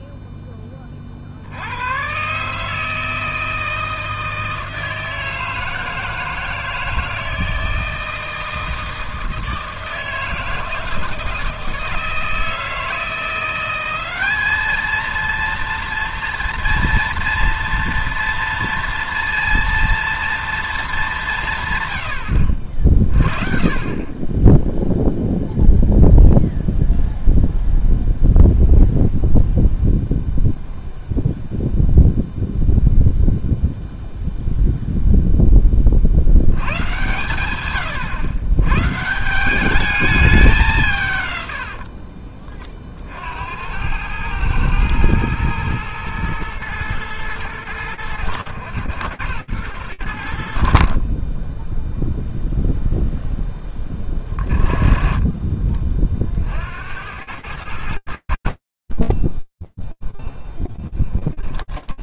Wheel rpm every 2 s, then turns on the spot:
40, 160, 160, 160, 160, 160, 170, 230, 230, 230, 190, 40, 0, 0, 0, 0, 0, 0, 130, 150, 120, 60, 110, 110, 100, 20, 0, 30, 100, 10, 10.
60-62